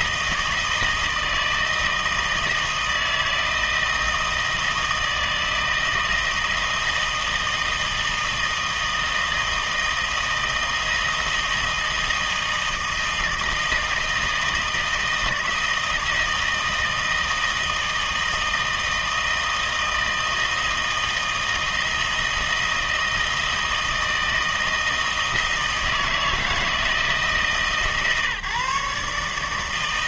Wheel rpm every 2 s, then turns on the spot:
160, 160, 160, 160, 160, 160, 160, 160, 160, 160, 160, 160, 160, 160, 150.
none